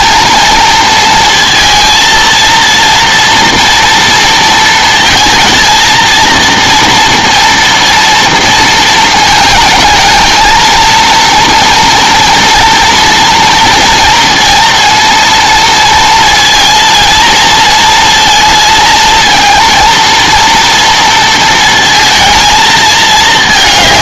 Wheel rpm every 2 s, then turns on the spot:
230, 230, 230, 230, 230, 230, 240, 230, 230, 220, 230, 220.
none